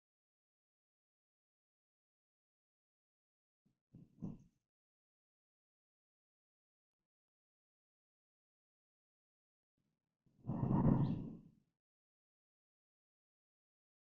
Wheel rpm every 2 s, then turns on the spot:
0, 0, 0, 0, 0, 0, 0.
none